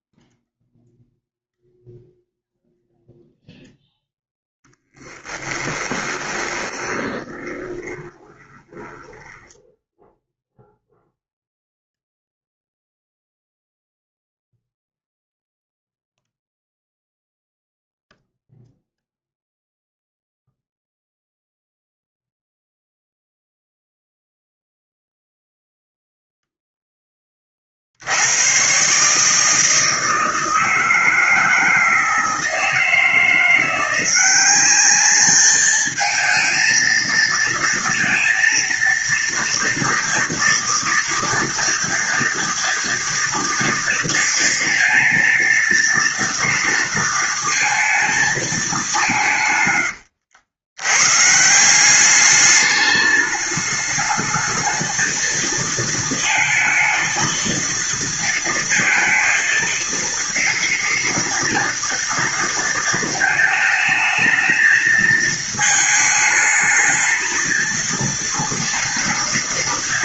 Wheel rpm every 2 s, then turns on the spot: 0, 0, 0, 20, 20, 0, 0, 0, 0, 0, 0, 0, 0, 0, 100, 160, 160, 190, 220, 230, 230, 230, 230, 230, 220, 90, 210, 220, 220, 230, 230, 230, 220, 220, 230.
6-10